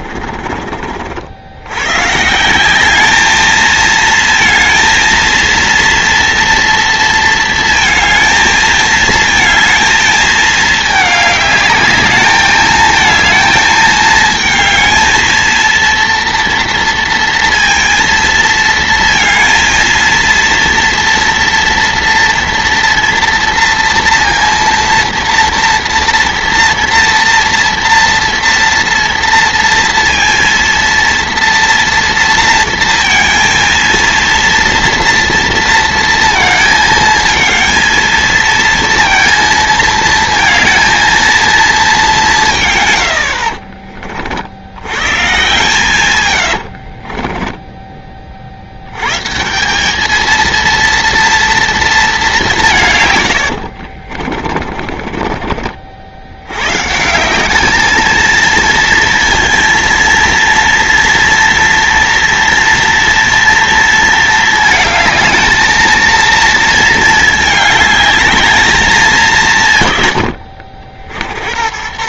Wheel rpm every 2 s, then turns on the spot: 50, 160, 220, 230, 230, 220, 220, 220, 230, 230, 230, 230, 230, 240, 240, 230, 230, 230, 230, 230, 230, 140, 80, 80, 70, 220, 190, 40, 120, 220, 230, 230, 220, 230, 210, 70.
46-48 54-56